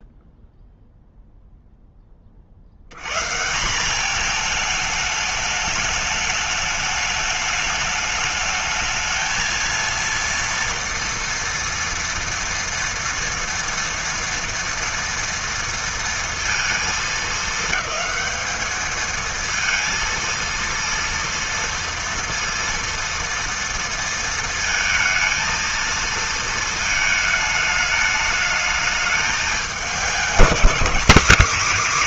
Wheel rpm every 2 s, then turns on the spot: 0, 60, 220, 210, 220, 230, 230, 230, 230, 210, 230, 230, 230, 230, 220, 220.
none